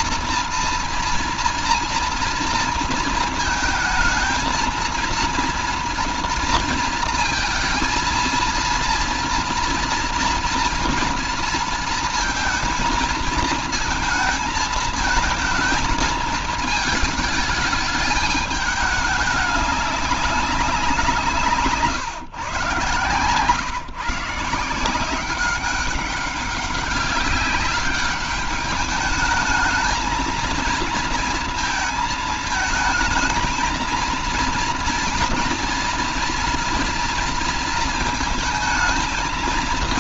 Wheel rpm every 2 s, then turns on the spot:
230, 230, 230, 230, 230, 230, 230, 230, 220, 210, 160, 110, 180, 200, 210, 230, 220, 240, 230, 220.
none